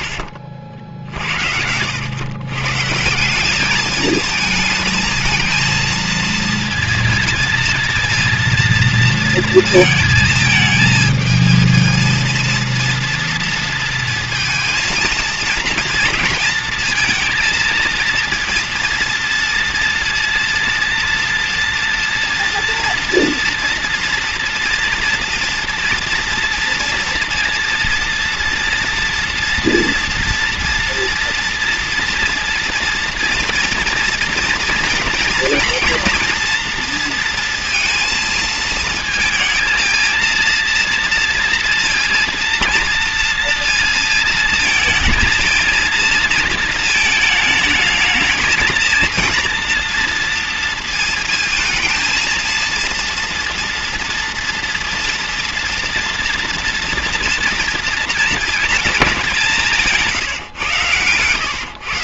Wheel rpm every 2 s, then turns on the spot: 60, 130, 220, 230, 230, 220, 230, 220, 230, 240, 230, 230, 230, 230, 230, 230, 230, 230, 230, 220, 230, 230, 230, 220, 220, 230, 230, 240, 230, 220, 130.
0-2